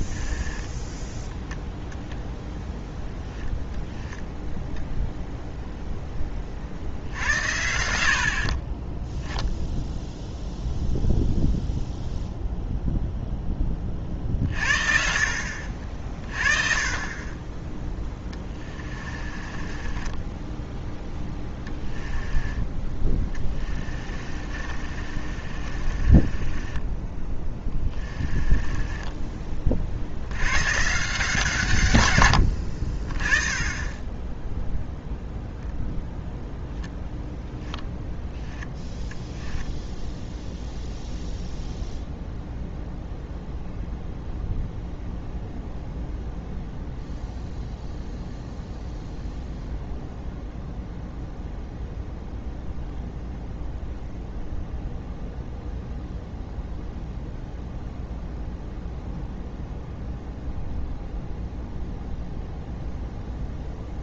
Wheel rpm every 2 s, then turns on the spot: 10, 0, 0, 50, 30, 0, 0, 50, 20, 20, 10, 10, 40, 20, 20, 130, 60, 0, 0, 0, 0, 0, 0, 0, 0, 0, 0, 0, 0, 0, 0, 0.
0-2 18-22 24-30